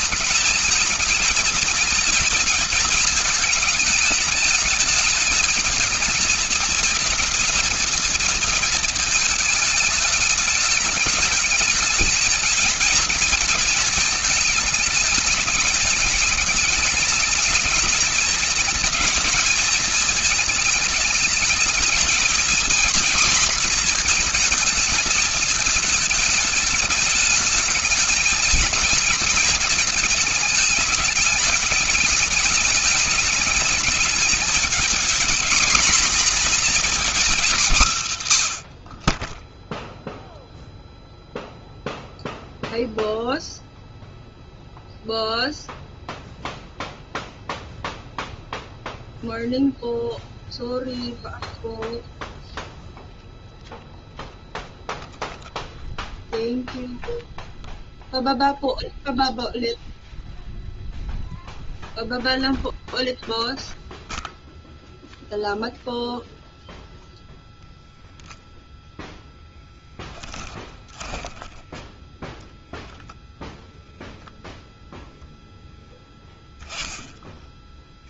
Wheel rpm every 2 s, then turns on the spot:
220, 220, 220, 230, 230, 210, 220, 220, 210, 220, 220, 240, 230, 210, 220, 210, 210, 220, 250, 100, 0, 0, 0, 0, 0, 0, 0, 0, 0, 0, 0, 0, 0, 0, 0, 10, 0, 0, 10.
70-72 76-78